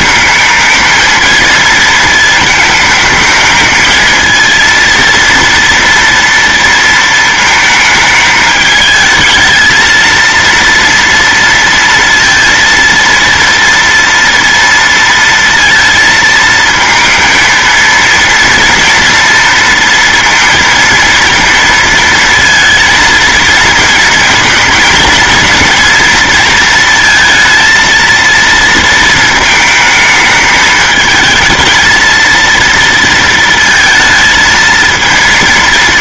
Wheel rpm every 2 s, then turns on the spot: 220, 220, 230, 230, 210, 230, 230, 230, 230, 240, 230, 230, 230, 230, 230, 220, 230, 230.
none